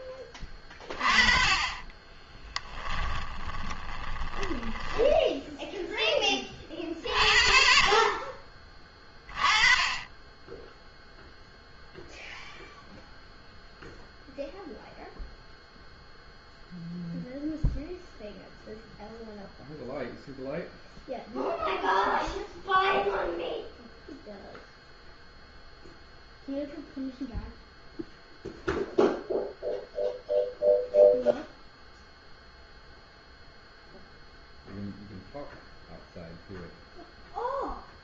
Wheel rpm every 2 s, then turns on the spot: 20, 20, 20, 30, 20, 10, 0, 0, 0, 0, 0, 0, 0, 0, 0, 0, 0, 0, 0.
2-6